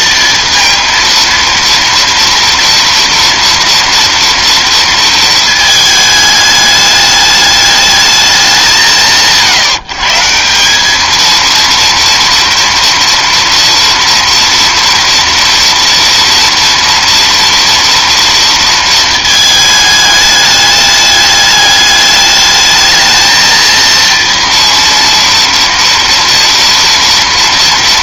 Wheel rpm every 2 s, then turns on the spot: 230, 230, 230, 210, 190, 190, 230, 230, 230, 230, 210, 210, 230, 230.
none